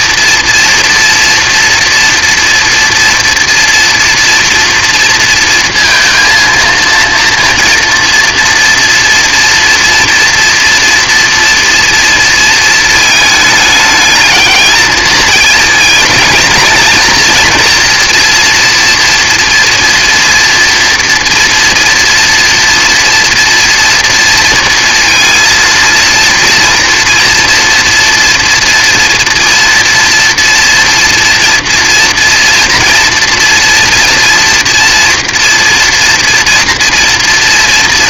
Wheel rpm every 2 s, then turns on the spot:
230, 230, 230, 230, 230, 230, 220, 220, 220, 230, 240, 230, 230, 240, 230, 230, 230, 230, 230.
none